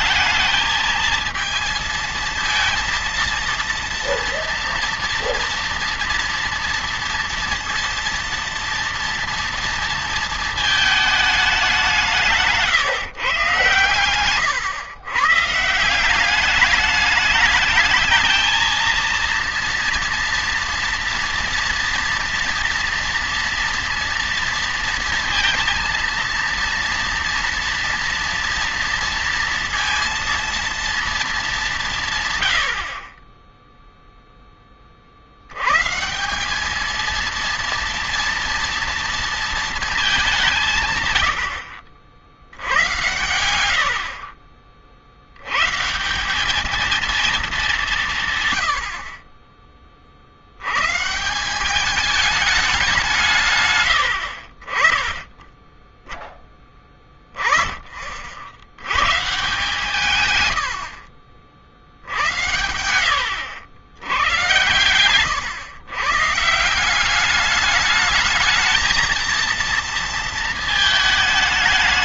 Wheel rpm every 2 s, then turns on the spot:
220, 230, 240, 230, 230, 220, 160, 120, 210, 230, 230, 230, 230, 230, 230, 230, 40, 40, 220, 230, 150, 90, 60, 220, 70, 120, 190, 40, 10, 110, 80, 80, 110, 170, 230, 220.
none